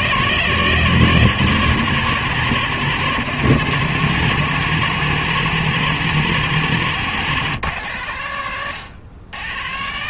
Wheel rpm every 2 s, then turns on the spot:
130, 120, 120, 130, 120.
none